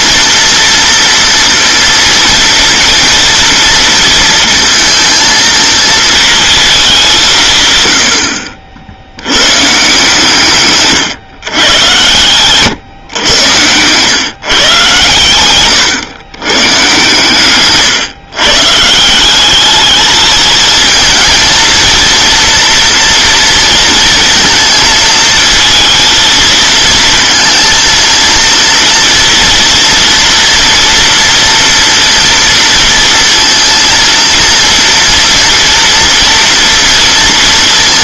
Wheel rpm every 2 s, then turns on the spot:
230, 240, 230, 220, 70, 140, 120, 130, 120, 140, 220, 230, 230, 220, 230, 230, 230, 240, 230.
none